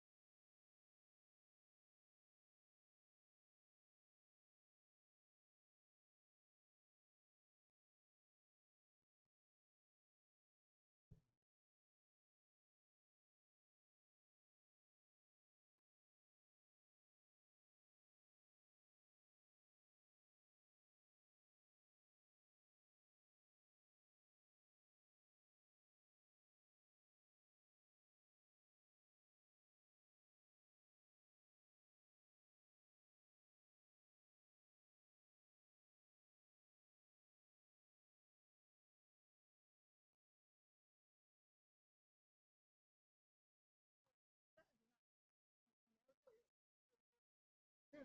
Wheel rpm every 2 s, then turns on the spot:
0, 0, 0, 0, 0, 0, 0, 0, 0, 0, 0, 0, 0, 0, 0, 0, 0, 0, 0, 0, 0, 0, 0, 0.
none